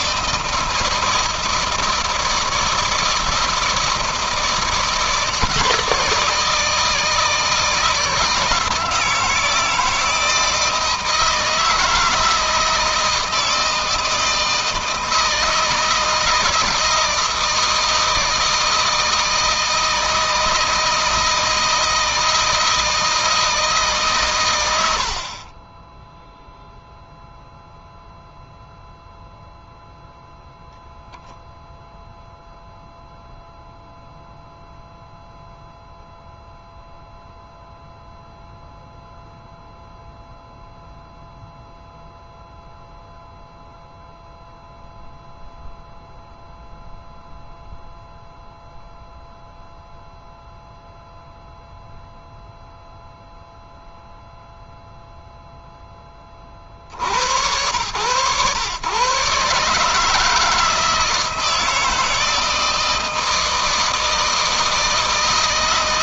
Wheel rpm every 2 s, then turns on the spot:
160, 160, 160, 160, 160, 160, 160, 160, 160, 160, 160, 160, 80, 0, 0, 0, 0, 0, 0, 0, 0, 0, 0, 0, 0, 0, 0, 0, 60, 120, 160, 160, 160.
none